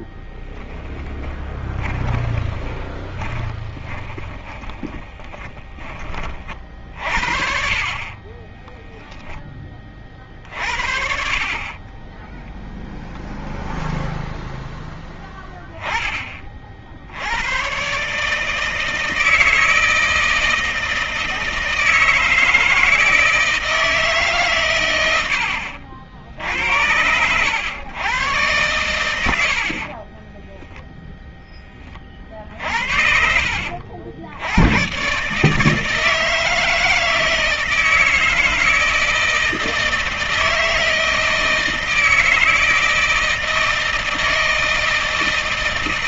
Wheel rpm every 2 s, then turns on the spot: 10, 20, 20, 50, 10, 50, 0, 10, 70, 160, 160, 160, 90, 90, 100, 0, 70, 130, 160, 160, 160, 160, 160.
0-6 8-10